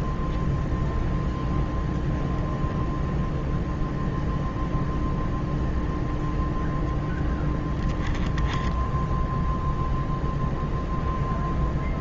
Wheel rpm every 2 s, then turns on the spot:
0, 0, 0, 0, 0, 0.
none